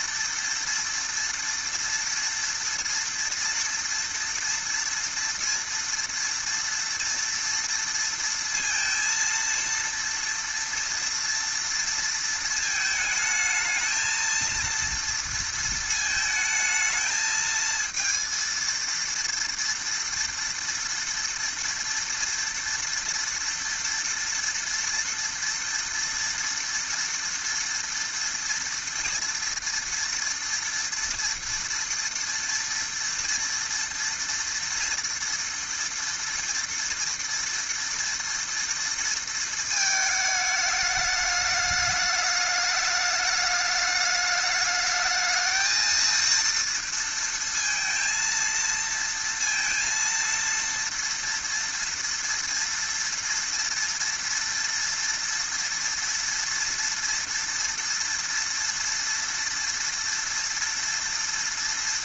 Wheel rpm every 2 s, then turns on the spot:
230, 230, 230, 230, 230, 230, 220, 230, 220, 230, 230, 230, 230, 230, 230, 230, 230, 230, 230, 230, 210, 210, 220, 230, 230, 230, 230, 230, 230, 230, 230.
none